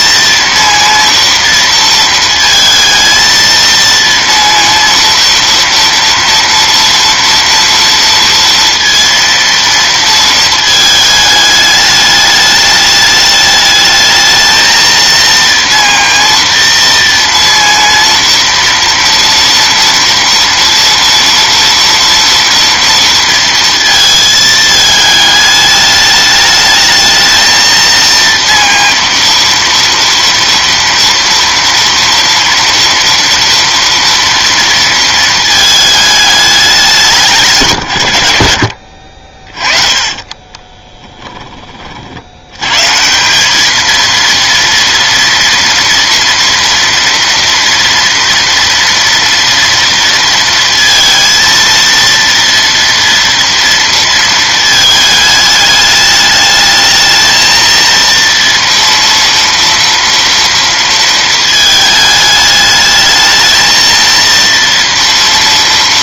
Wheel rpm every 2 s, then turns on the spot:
230, 230, 230, 230, 230, 220, 210, 220, 230, 230, 230, 230, 220, 210, 230, 230, 230, 230, 200, 80, 20, 100, 230, 230, 230, 230, 230, 220, 210, 230, 230, 210, 230.
40-42